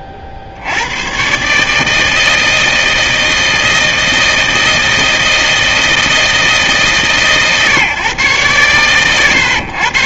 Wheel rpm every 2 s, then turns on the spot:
60, 160, 160, 160, 110.
none